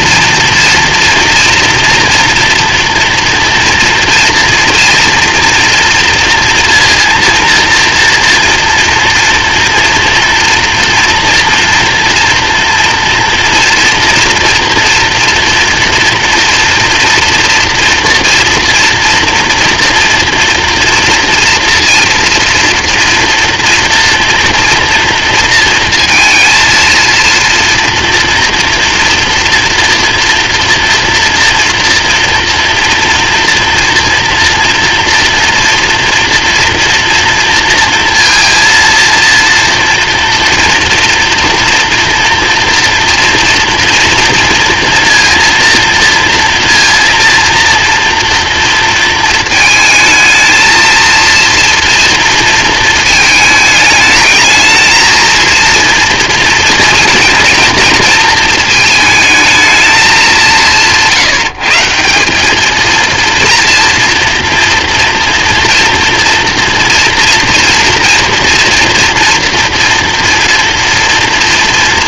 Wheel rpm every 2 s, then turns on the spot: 230, 230, 230, 230, 230, 240, 240, 230, 230, 230, 230, 230, 230, 230, 230, 230, 230, 230, 240, 230, 230, 230, 230, 230, 230, 230, 220, 220, 230, 220, 150, 220, 230, 230, 230, 230.
none